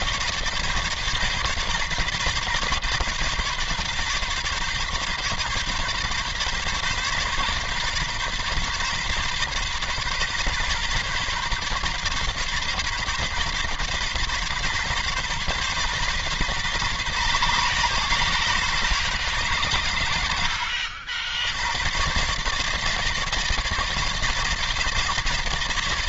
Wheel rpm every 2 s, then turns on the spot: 140, 140, 140, 140, 140, 140, 140, 130, 140, 140, 70, 150, 160.
none